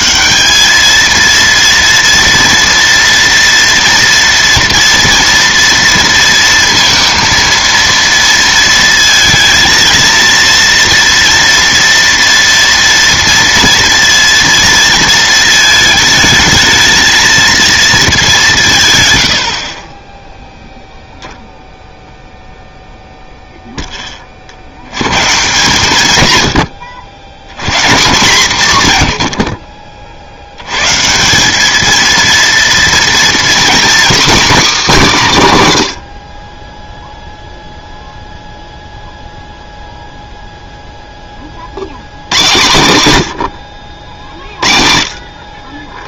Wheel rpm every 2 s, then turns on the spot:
220, 230, 230, 230, 230, 230, 230, 230, 220, 160, 0, 0, 60, 110, 160, 110, 230, 250, 10, 0, 0, 110, 50.
none